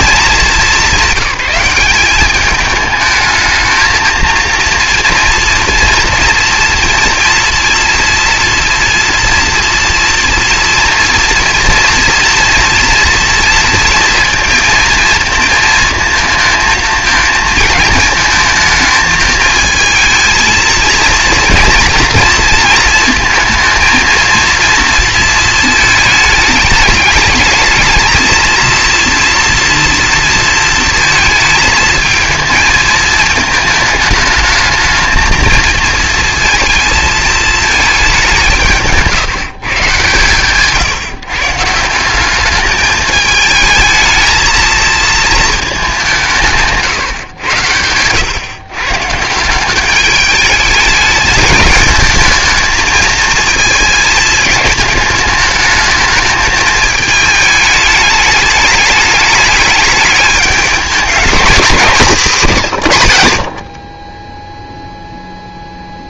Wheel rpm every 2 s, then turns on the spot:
190, 210, 230, 240, 240, 230, 230, 230, 220, 220, 230, 230, 230, 210, 230, 220, 220, 220, 220, 170, 140, 210, 220, 160, 140, 210, 220, 220, 220, 210, 200, 160, 0.
none